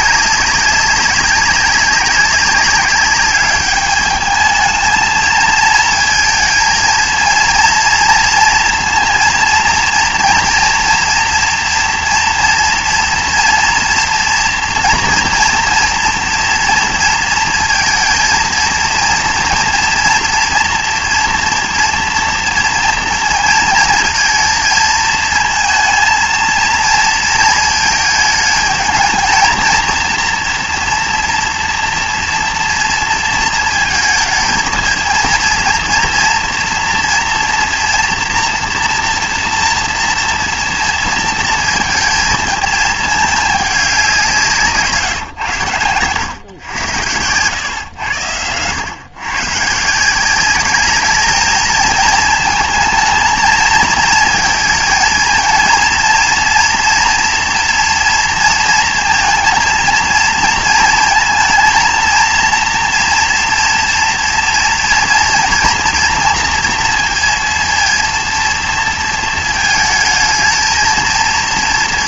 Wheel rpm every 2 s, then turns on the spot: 190, 200, 220, 230, 230, 240, 240, 230, 230, 230, 240, 230, 230, 230, 220, 240, 230, 230, 240, 240, 230, 220, 170, 110, 100, 210, 220, 220, 230, 230, 230, 240, 240, 230, 230, 220.
none